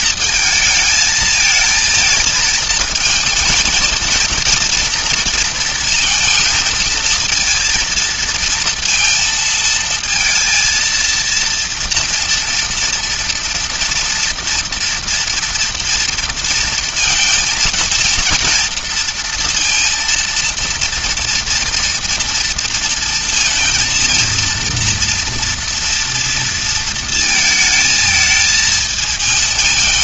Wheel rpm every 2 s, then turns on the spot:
220, 220, 230, 230, 230, 230, 230, 230, 230, 230, 230, 230, 230, 230, 220.
none